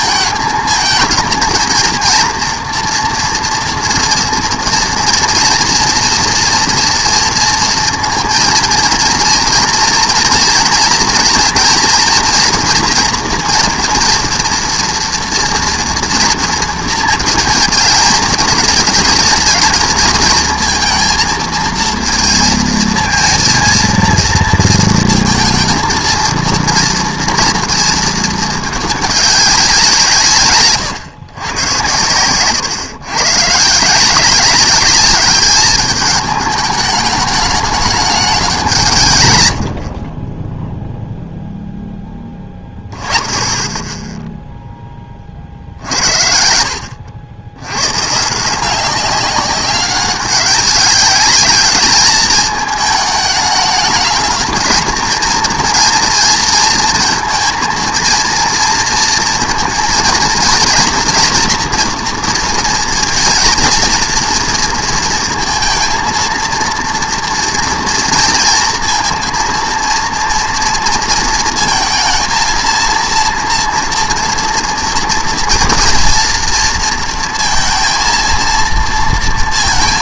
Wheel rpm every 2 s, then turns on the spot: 230, 240, 230, 230, 230, 230, 240, 240, 220, 220, 230, 230, 230, 230, 200, 110, 130, 210, 210, 110, 0, 10, 10, 60, 170, 200, 210, 220, 220, 230, 230, 230, 230, 230, 230, 230, 230, 230, 230, 230.
38-40